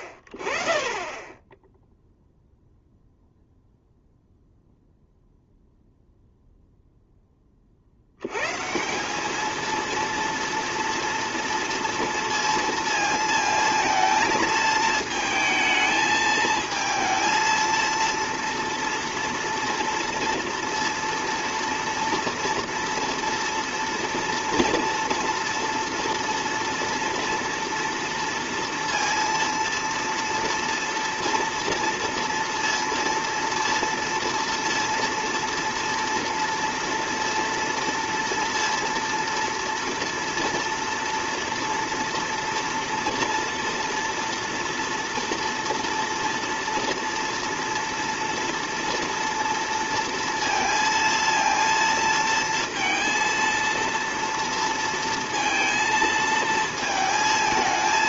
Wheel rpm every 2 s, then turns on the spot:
40, 0, 0, 0, 120, 230, 230, 220, 220, 230, 240, 230, 230, 230, 230, 230, 230, 230, 230, 230, 230, 230, 240, 230, 230, 230, 230, 230, 230.
none